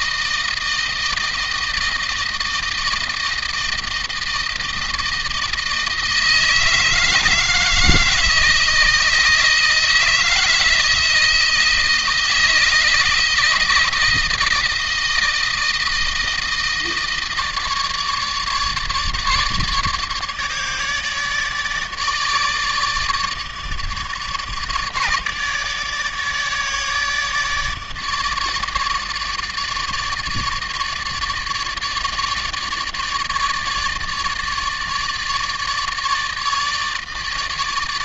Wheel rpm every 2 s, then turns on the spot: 160, 160, 160, 160, 160, 160, 160, 160, 160, 150, 150, 150, 150, 150, 150, 150, 150, 150, 160.
none